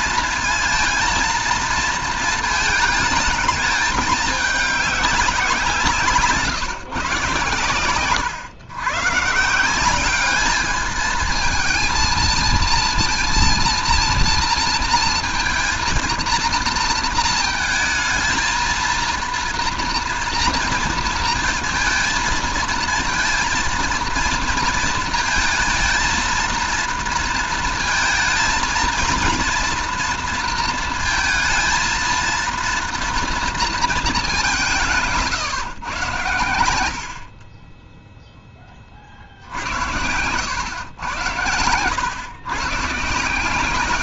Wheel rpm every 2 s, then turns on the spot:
230, 220, 200, 150, 120, 210, 230, 230, 230, 220, 230, 230, 230, 230, 230, 230, 230, 180, 80, 20, 100, 140.
none